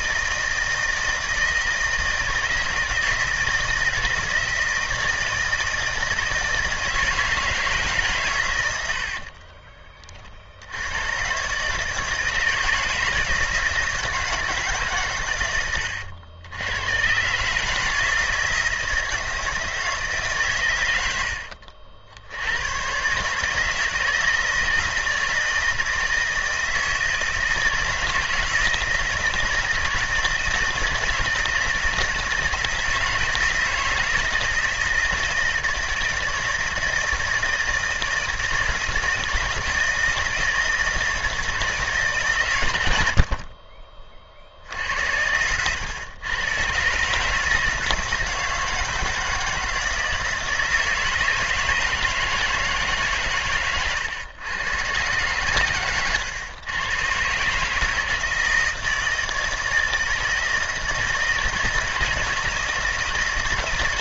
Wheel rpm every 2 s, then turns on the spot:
160, 160, 160, 160, 80, 90, 160, 140, 110, 160, 100, 120, 160, 160, 160, 160, 160, 160, 160, 160, 160, 90, 80, 140, 160, 160, 150, 120, 120, 160, 160, 160.
none